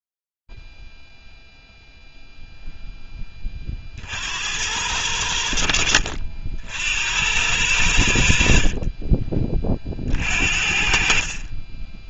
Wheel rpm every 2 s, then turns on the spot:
10, 0, 40, 70, 90, 30.
none